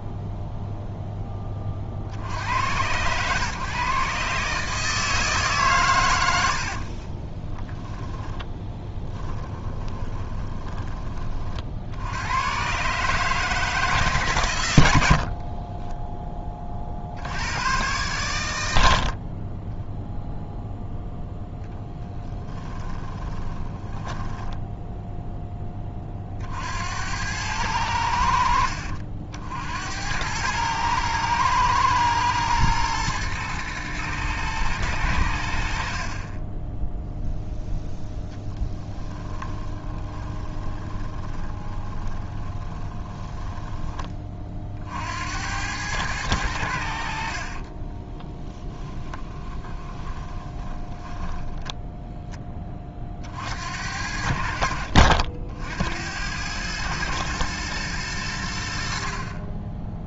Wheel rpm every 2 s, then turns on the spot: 0, 110, 160, 50, 10, 20, 140, 80, 50, 80, 0, 20, 10, 70, 60, 110, 110, 100, 10, 10, 20, 20, 60, 80, 10, 20, 30, 50, 110, 50.
6-10 22-24 40-44 48-52